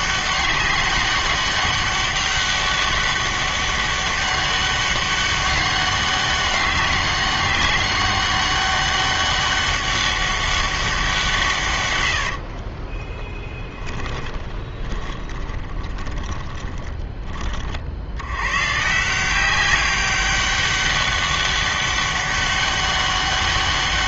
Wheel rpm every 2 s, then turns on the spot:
190, 200, 200, 200, 200, 200, 50, 20, 20, 120, 200, 200.
12-18